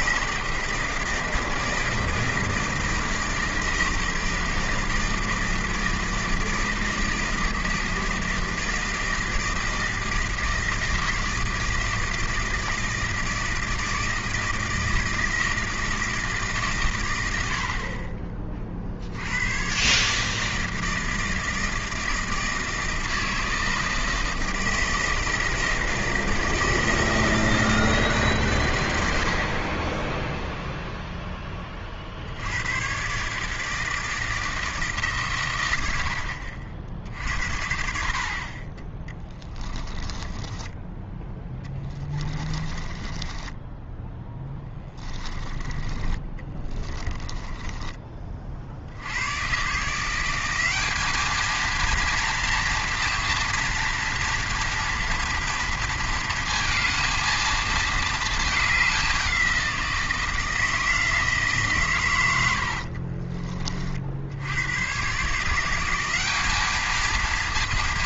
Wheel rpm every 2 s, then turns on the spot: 160, 160, 160, 160, 160, 160, 160, 160, 150, 40, 160, 160, 160, 160, 120, 0, 90, 160, 50, 30, 10, 20, 10, 20, 60, 200, 230, 230, 220, 210, 160, 90, 100, 210.
40-48 62-64